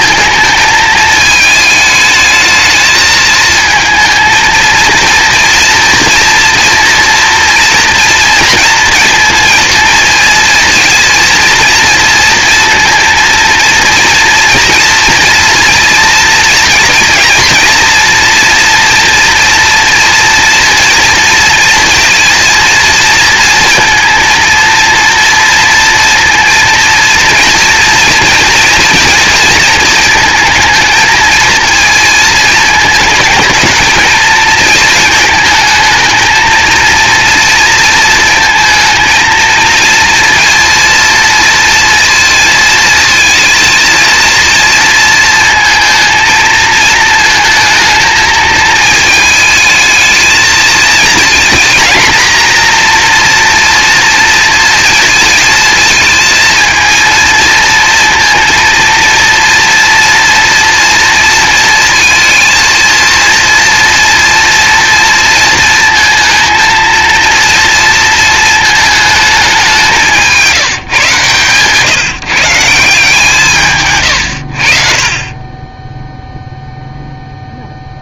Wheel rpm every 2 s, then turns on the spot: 220, 220, 230, 240, 230, 230, 230, 230, 230, 230, 230, 230, 230, 230, 230, 220, 220, 220, 230, 230, 230, 230, 230, 220, 220, 220, 230, 230, 230, 230, 230, 230, 230, 220, 220, 150, 160, 50, 0.
none